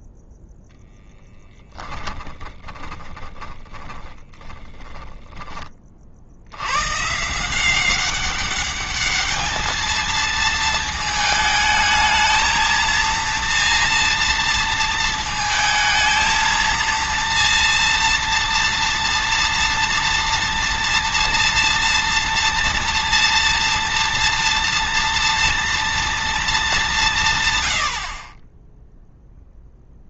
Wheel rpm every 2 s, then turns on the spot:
0, 20, 30, 110, 200, 220, 230, 230, 230, 230, 230, 230, 240, 180, 10.
2-6